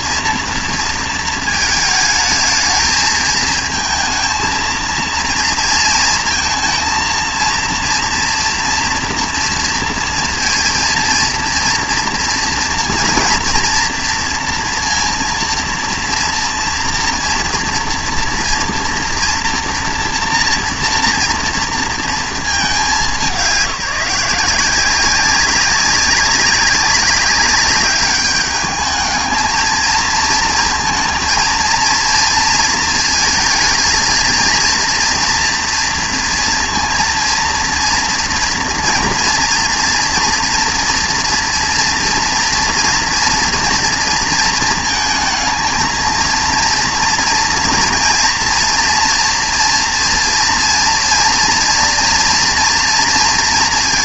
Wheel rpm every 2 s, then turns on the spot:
230, 220, 230, 230, 230, 230, 230, 230, 230, 230, 230, 200, 170, 200, 210, 230, 230, 230, 230, 240, 230, 240, 220, 230, 230, 230, 240.
none